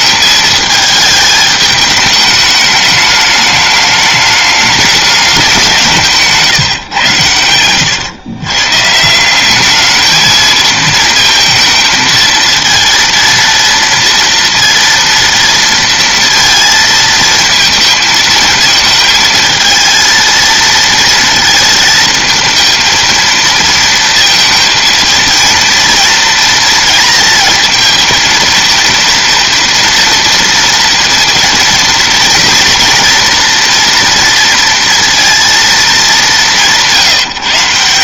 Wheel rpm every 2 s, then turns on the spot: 220, 210, 210, 140, 140, 220, 230, 230, 230, 220, 230, 220, 230, 230, 230, 230, 240, 230, 180.
none